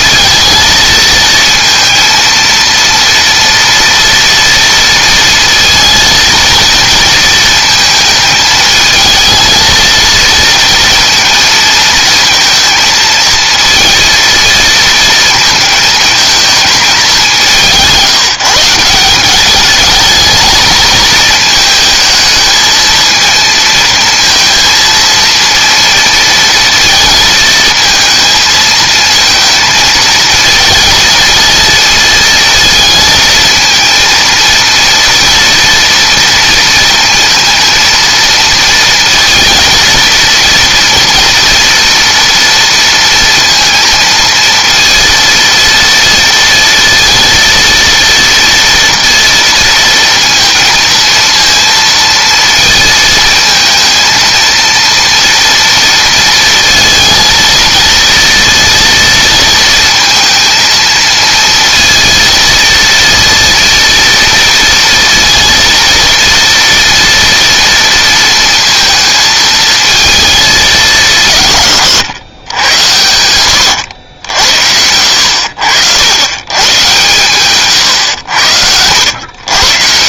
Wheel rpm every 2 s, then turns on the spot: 220, 230, 230, 230, 220, 230, 230, 230, 210, 180, 210, 220, 230, 230, 220, 230, 230, 230, 230, 230, 230, 230, 230, 230, 230, 230, 220, 230, 220, 230, 230, 230, 230, 230, 230, 190, 90, 80, 120, 80.
72-74